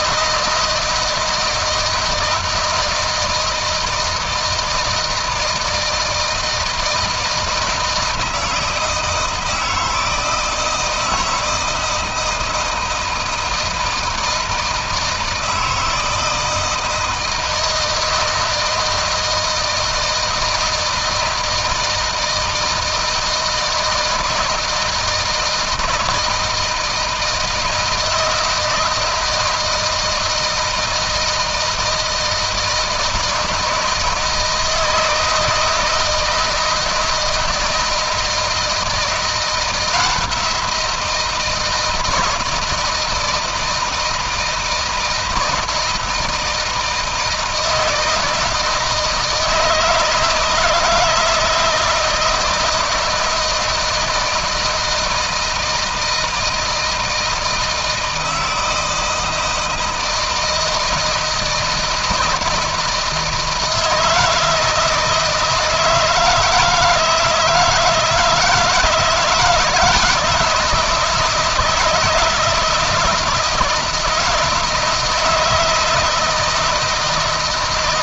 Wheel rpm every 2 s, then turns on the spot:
160, 160, 160, 160, 160, 160, 160, 160, 160, 160, 160, 160, 160, 160, 160, 160, 160, 160, 160, 170, 170, 160, 160, 160, 160, 170, 170, 160, 160, 160, 160, 160, 160, 160, 160, 160, 160, 160, 160.
none